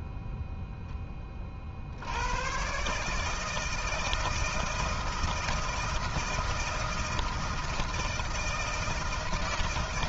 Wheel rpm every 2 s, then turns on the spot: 0, 100, 160, 160, 160.
none